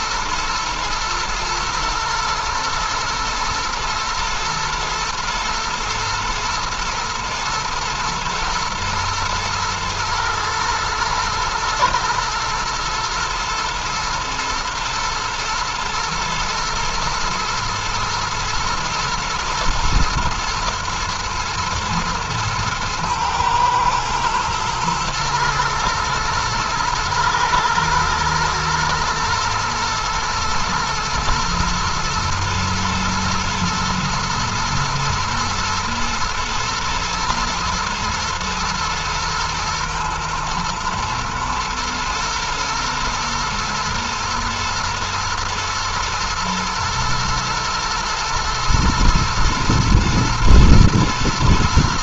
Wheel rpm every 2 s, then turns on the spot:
120, 110, 110, 120, 110, 120, 120, 110, 120, 110, 120, 110, 110, 110, 110, 110, 120, 120, 120, 120, 110, 120, 120, 110, 120, 120.
none